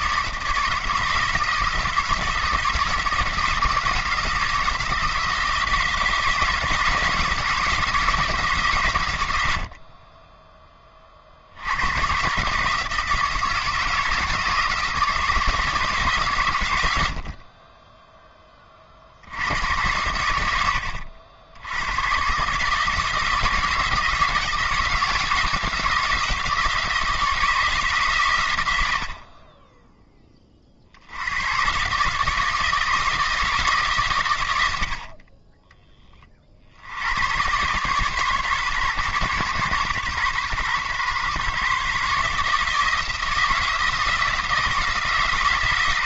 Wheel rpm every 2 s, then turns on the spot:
170, 170, 170, 160, 140, 20, 150, 160, 100, 40, 80, 150, 170, 170, 80, 50, 160, 80, 70, 130, 130, 160, 160.
none